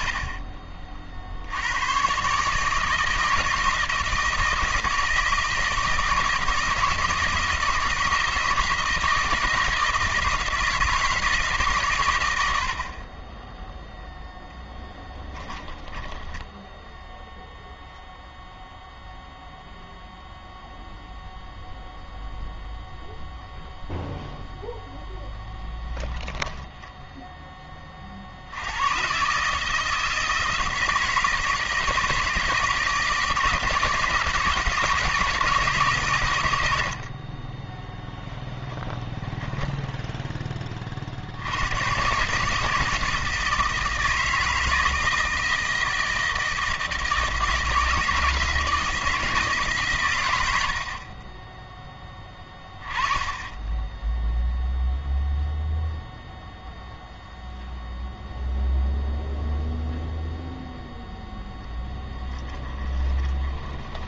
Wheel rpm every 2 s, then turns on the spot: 40, 160, 160, 160, 160, 160, 60, 10, 10, 0, 0, 0, 0, 10, 110, 160, 160, 160, 70, 10, 30, 150, 160, 160, 160, 70, 20, 0, 0, 0, 0, 10.
14-16 62-64